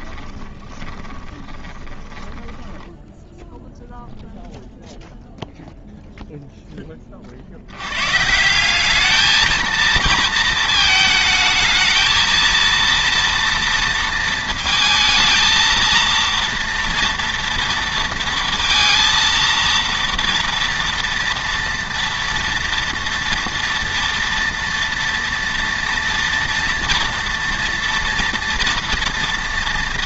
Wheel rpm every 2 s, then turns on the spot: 20, 10, 0, 10, 180, 230, 230, 220, 230, 230, 230, 230, 230, 240, 230.
0-2